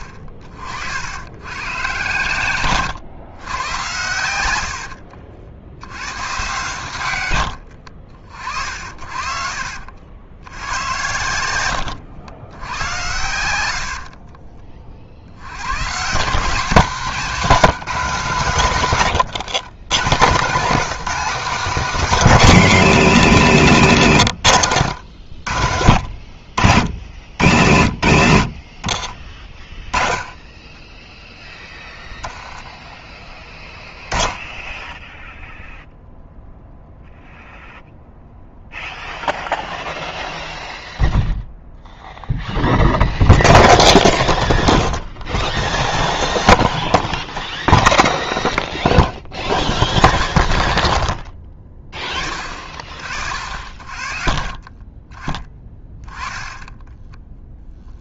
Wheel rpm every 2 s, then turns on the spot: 60, 120, 80, 130, 50, 90, 100, 60, 200, 150, 170, 200, 110, 70, 50, 10, 10, 10, 0, 0, 0, 0, 0, 0, 0, 0, 40, 30, 10.
4-6 18-20 54-56